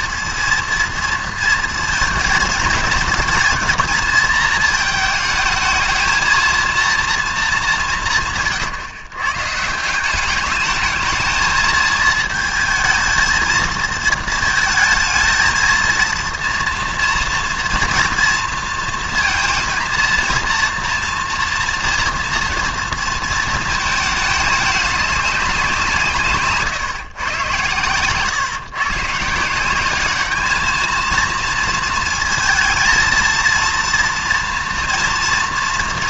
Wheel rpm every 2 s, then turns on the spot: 230, 210, 220, 230, 130, 210, 220, 220, 230, 230, 230, 230, 210, 140, 130, 220, 230, 230.
none